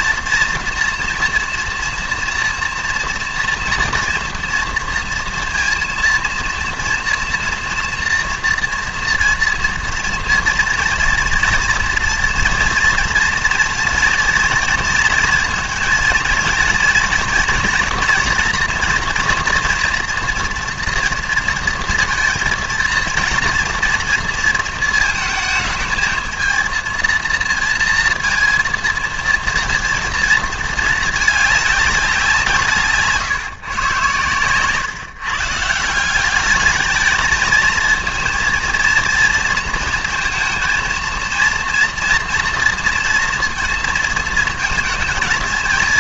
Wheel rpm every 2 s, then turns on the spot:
230, 230, 230, 230, 240, 230, 230, 230, 240, 240, 230, 230, 220, 230, 230, 220, 160, 130, 210, 230, 230, 230, 220.
none